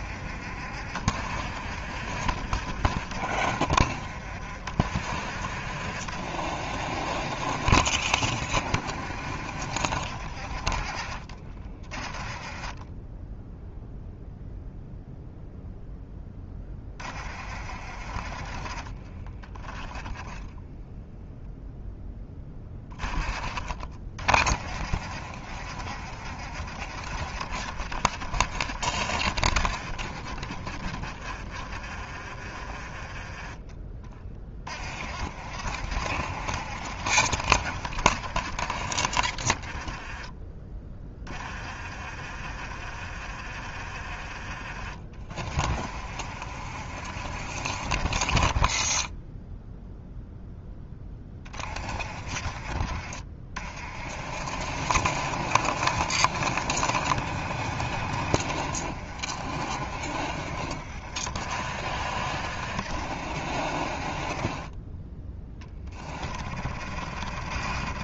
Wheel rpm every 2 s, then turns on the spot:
60, 60, 60, 60, 60, 40, 20, 0, 30, 30, 0, 20, 40, 60, 60, 40, 30, 40, 60, 50, 20, 40, 40, 50, 30, 10, 40, 60, 60, 60, 50, 60, 20, 50.
12-14